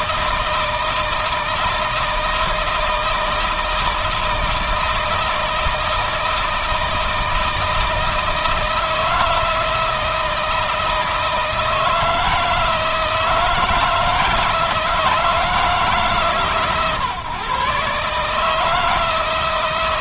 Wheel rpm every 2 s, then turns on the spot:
160, 160, 160, 160, 160, 160, 160, 160, 130, 160.
none